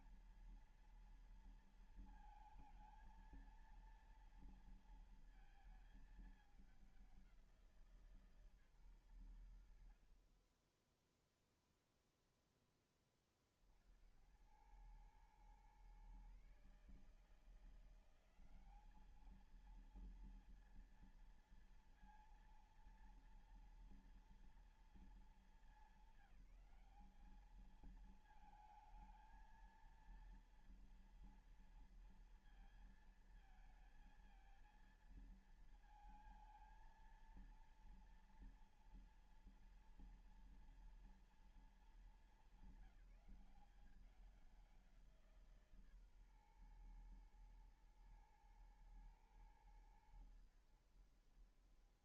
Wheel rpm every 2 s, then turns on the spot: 230, 230, 230, 210, 150, 40, 0, 80, 130, 190, 230, 230, 230, 200, 220, 230, 230, 230, 230, 230, 230, 220, 190, 130, 110, 100.
none